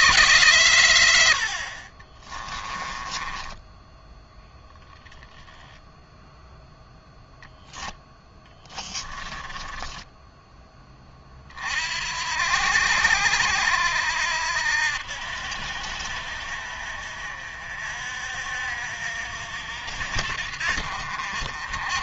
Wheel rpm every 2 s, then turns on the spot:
100, 20, 0, 0, 20, 20, 70, 80, 60, 60, 60.
2-4 8-10